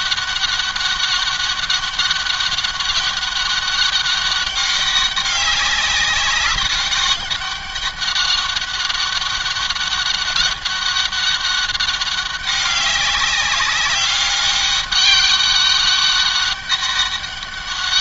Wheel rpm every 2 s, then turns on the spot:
200, 200, 200, 200, 200, 200, 200, 200, 200.
none